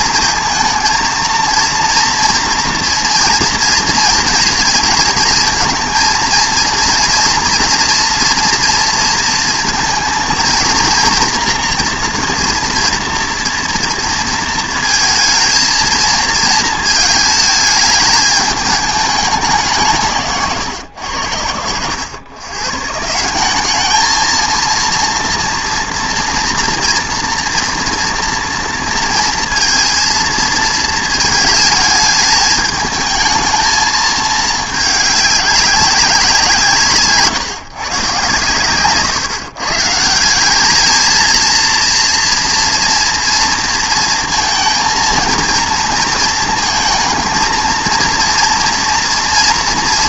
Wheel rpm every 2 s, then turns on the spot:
230, 230, 230, 230, 230, 230, 240, 220, 220, 210, 130, 140, 230, 240, 230, 220, 210, 210, 170, 120, 200, 230, 230, 220, 230.
20-22